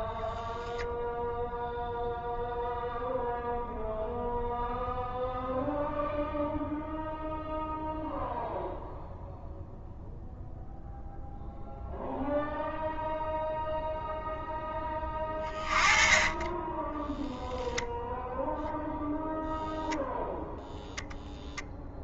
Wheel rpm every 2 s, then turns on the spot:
0, 0, 0, 0, 0, 0, 0, 20, 10, 0, 0.
14-16